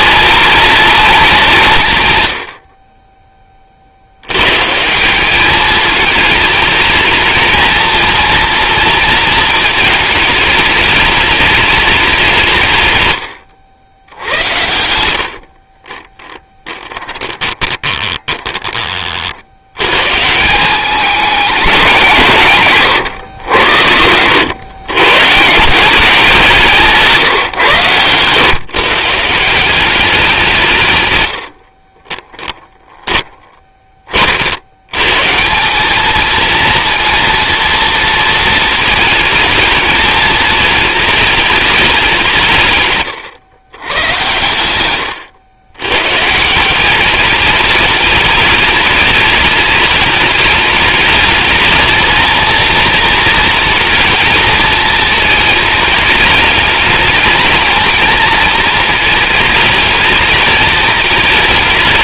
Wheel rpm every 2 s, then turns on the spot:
220, 20, 150, 220, 230, 210, 120, 110, 20, 30, 200, 140, 100, 170, 140, 130, 10, 70, 230, 220, 220, 130, 130, 190, 210, 210, 230, 220, 220, 220, 220.
16-18 22-24 32-34 44-46